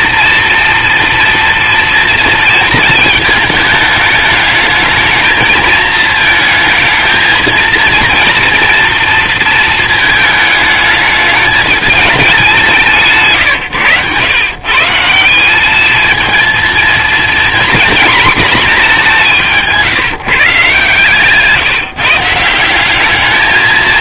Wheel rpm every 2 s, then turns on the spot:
230, 230, 220, 220, 230, 220, 190, 140, 230, 220, 130, 170.
none